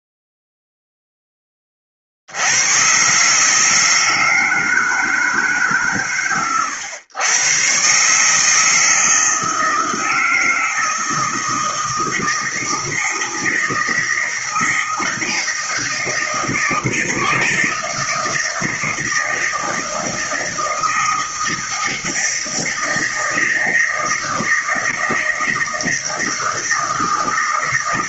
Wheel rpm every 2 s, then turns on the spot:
0, 110, 160, 120, 160, 160, 160, 160, 160, 160, 160, 160, 160, 160.
none